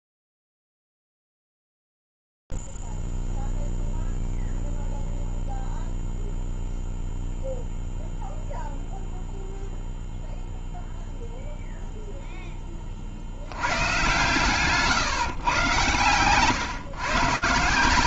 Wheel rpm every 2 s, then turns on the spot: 0, 0, 0, 0, 0, 0, 0, 100, 130.
none